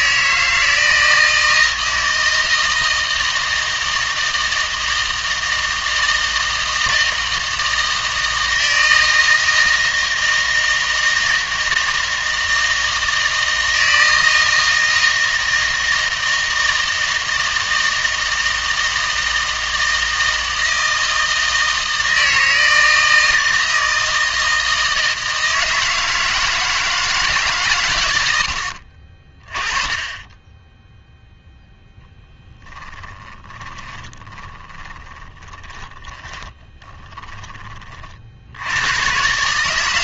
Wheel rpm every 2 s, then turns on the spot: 160, 160, 160, 160, 160, 160, 160, 160, 160, 160, 160, 160, 160, 160, 80, 10, 10, 20, 20, 80.
32-38